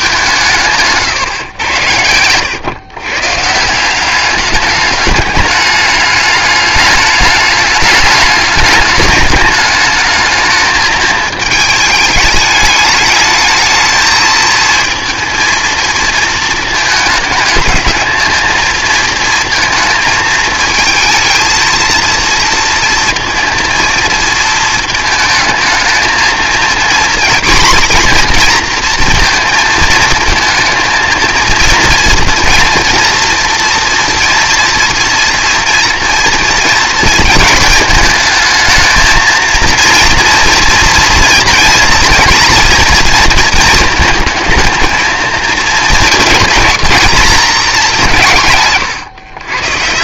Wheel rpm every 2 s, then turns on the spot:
170, 110, 200, 210, 200, 220, 210, 220, 220, 220, 220, 230, 220, 230, 240, 220, 230, 230, 230, 220, 240, 240, 220, 230, 160.
none